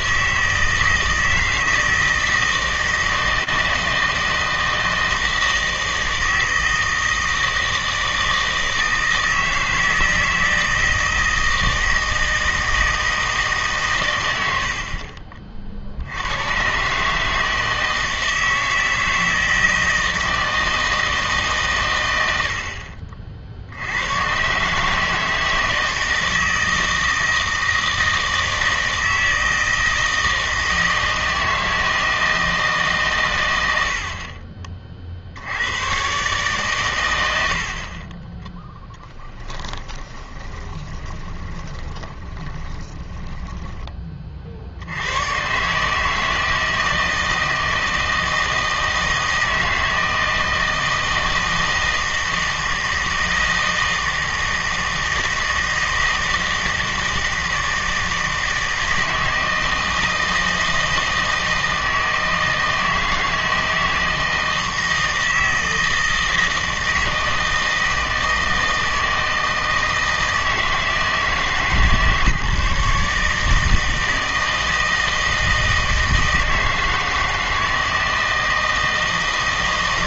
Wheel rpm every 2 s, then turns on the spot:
160, 160, 160, 160, 160, 160, 160, 80, 130, 160, 160, 70, 140, 160, 160, 160, 150, 30, 120, 0, 20, 20, 60, 160, 160, 160, 160, 160, 160, 160, 160, 160, 160, 160, 160, 160, 150, 160, 160, 160.
40-44